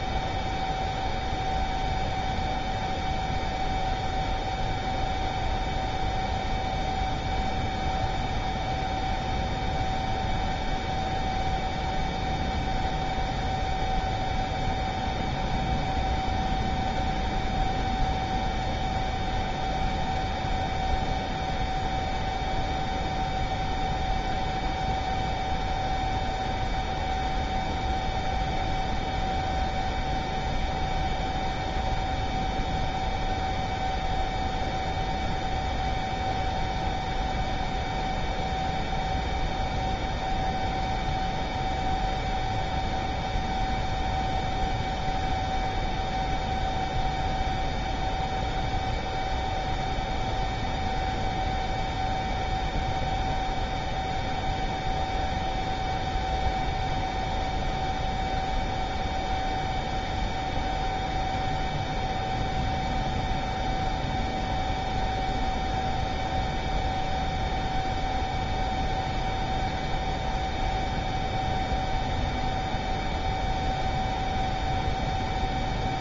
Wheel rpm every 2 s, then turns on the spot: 0, 0, 0, 0, 0, 0, 0, 0, 0, 0, 0, 0, 0, 0, 0, 0, 0, 0, 0, 0, 0, 0, 0, 0, 0, 0, 0, 0, 0, 0, 0, 0, 0, 0, 0, 0, 0, 0.
none